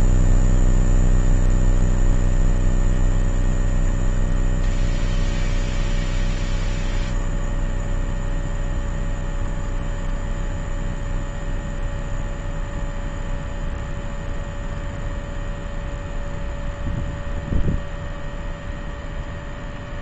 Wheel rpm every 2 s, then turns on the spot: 0, 0, 0, 0, 0, 0, 0, 0, 0, 0.
none